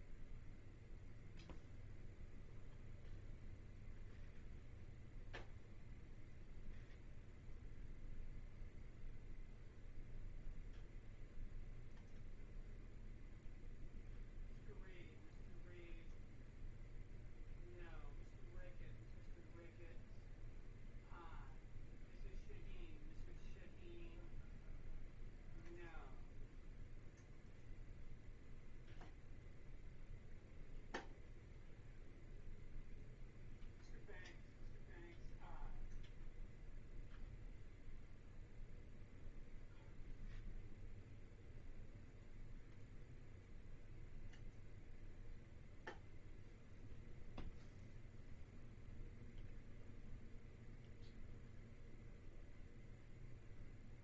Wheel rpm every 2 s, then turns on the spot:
0, 0, 0, 0, 0, 0, 0, 0, 0, 0, 0, 0, 0, 0, 0, 0, 0, 0, 0, 0, 0, 0, 0, 0, 0, 0, 0.
none